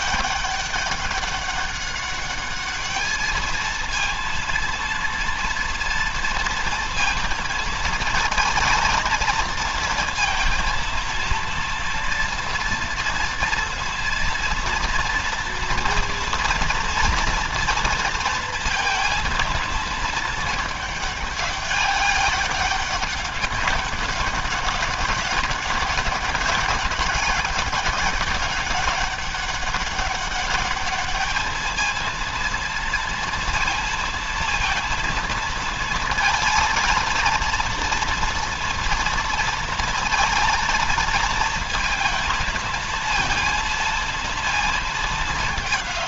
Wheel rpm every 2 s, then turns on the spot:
190, 210, 230, 230, 230, 230, 230, 230, 230, 230, 210, 200, 200, 200, 200, 210, 230, 230, 230, 230, 230, 230, 220.
none